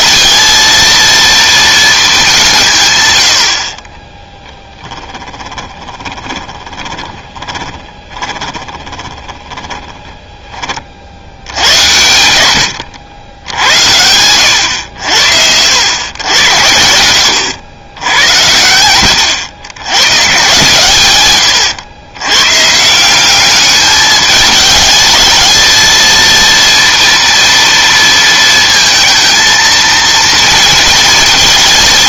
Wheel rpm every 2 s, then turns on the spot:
230, 150, 10, 20, 20, 40, 90, 100, 90, 110, 140, 140, 210, 230, 230, 230.
4-10